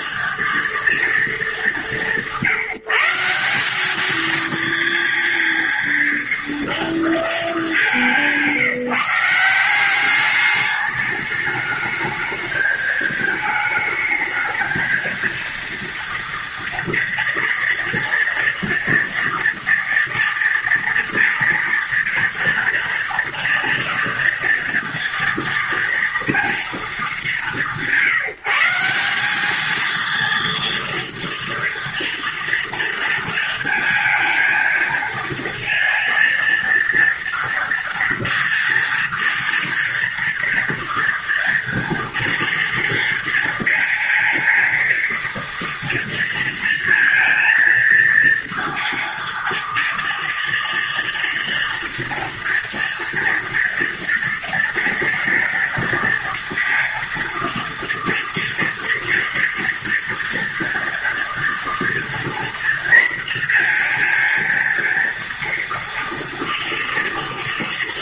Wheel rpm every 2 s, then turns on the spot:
230, 180, 230, 230, 180, 200, 220, 220, 230, 230, 230, 230, 230, 230, 180, 230, 230, 220, 230, 230, 230, 230, 230, 230, 230, 230, 230, 230, 230, 230, 230, 230, 230, 230.
none